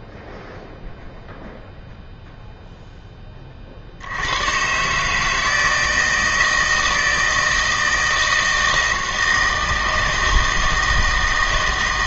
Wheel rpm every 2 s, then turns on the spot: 0, 0, 130, 160, 160, 160.
none